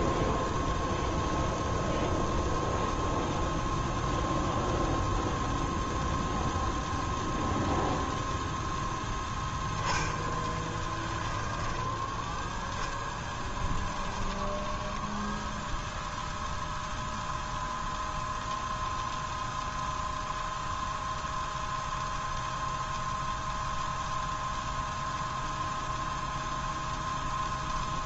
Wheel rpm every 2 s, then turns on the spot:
0, 0, 0, 0, 0, 10, 10, 20, 0, 0, 0, 0, 0, 0.
14-16